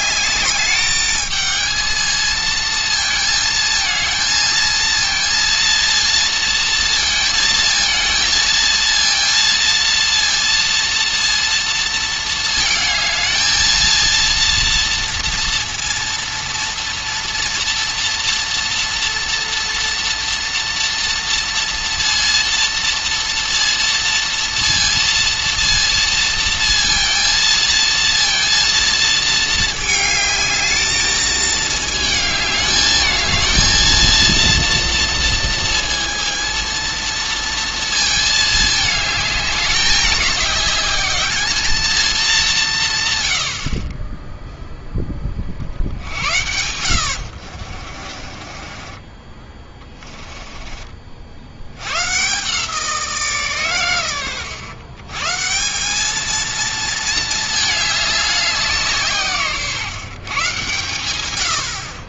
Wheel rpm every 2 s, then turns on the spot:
210, 220, 230, 230, 230, 230, 220, 230, 230, 230, 230, 230, 230, 230, 230, 220, 220, 230, 230, 220, 210, 160, 0, 80, 30, 30, 160, 110, 230, 170, 130.
48-52